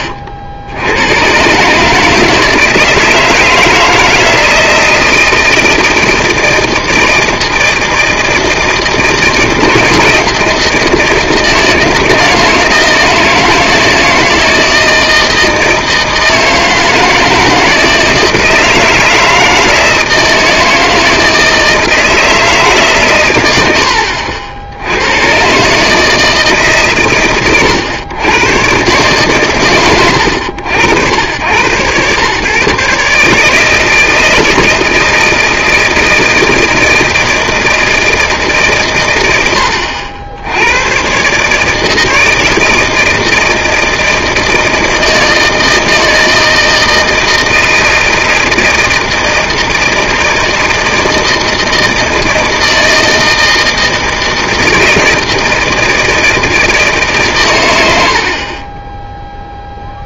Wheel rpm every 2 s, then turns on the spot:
80, 160, 160, 160, 160, 160, 160, 160, 160, 170, 160, 150, 80, 150, 120, 100, 130, 160, 160, 130, 100, 160, 160, 160, 160, 160, 160, 160, 160, 20.
58-60